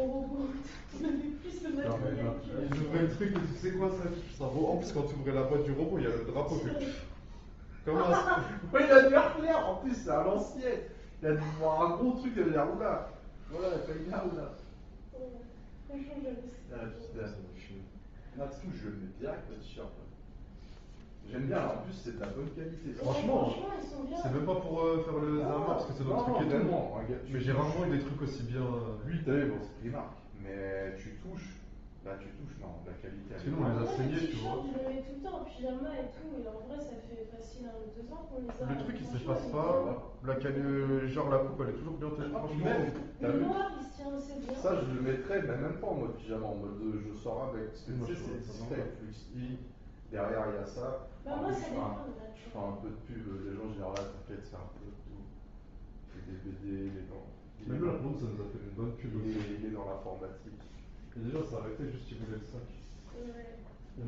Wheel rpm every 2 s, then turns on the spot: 0, 0, 0, 0, 0, 0, 0, 0, 0, 0, 0, 0, 0, 0, 0, 0, 0, 0, 0, 0, 0, 0, 0, 0, 0, 0, 0, 0, 0, 0, 0, 0.
none